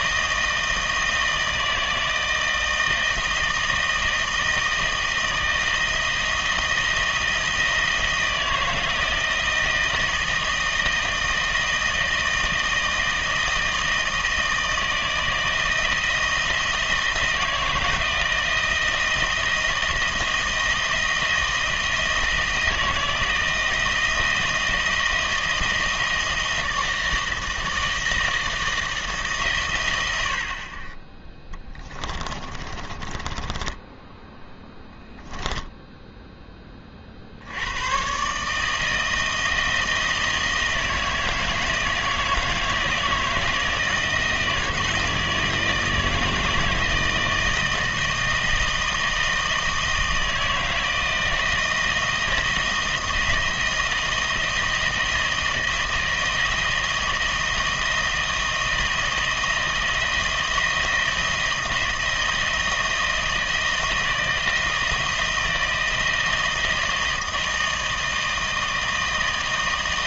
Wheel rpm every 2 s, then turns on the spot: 160, 160, 160, 160, 160, 160, 160, 160, 170, 160, 160, 160, 160, 160, 170, 50, 30, 10, 20, 150, 160, 160, 160, 160, 160, 160, 160, 160, 160, 160, 170, 160, 160, 160, 160.
32-36